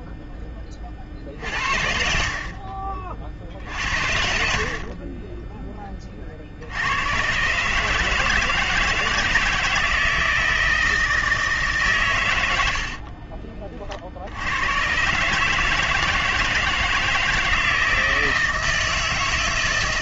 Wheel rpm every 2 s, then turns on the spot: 10, 40, 70, 60, 160, 160, 80, 80, 160, 160.
4-6